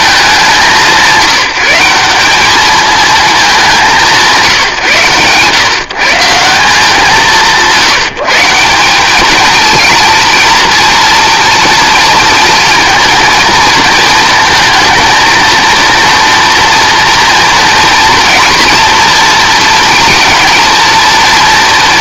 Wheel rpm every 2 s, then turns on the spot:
190, 220, 160, 180, 180, 230, 230, 220, 230, 230, 230.
none